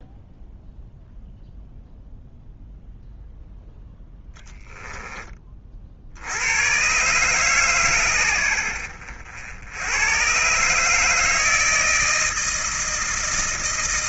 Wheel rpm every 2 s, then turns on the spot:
0, 0, 10, 90, 90, 130, 160.
none